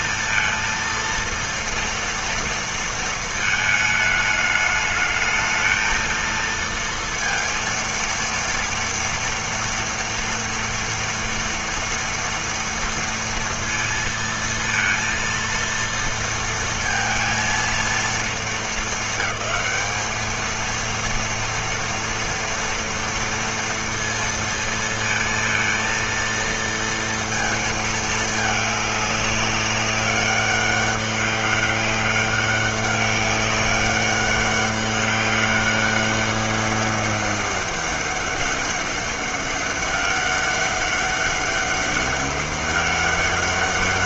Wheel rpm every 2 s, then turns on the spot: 230, 230, 210, 230, 230, 230, 230, 230, 230, 210, 220, 230, 230, 230, 210, 200, 200, 200, 200, 200, 200, 190.
none